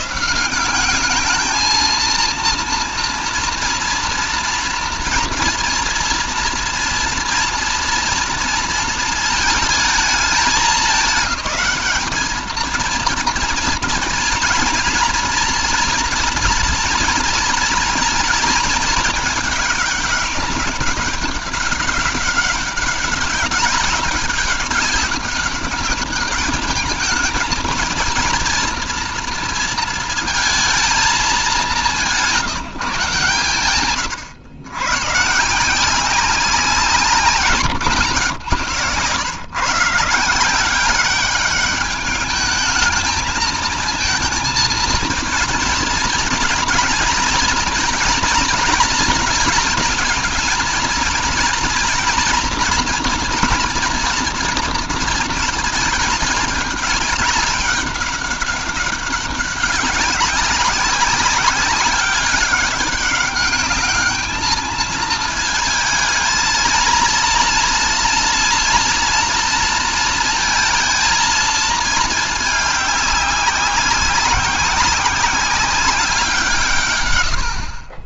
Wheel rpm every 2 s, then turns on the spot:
180, 230, 230, 230, 230, 210, 230, 240, 230, 230, 200, 200, 190, 210, 230, 230, 150, 120, 180, 140, 190, 220, 230, 240, 220, 230, 240, 230, 210, 200, 190, 200, 220, 220, 230, 230, 210, 190, 150.
none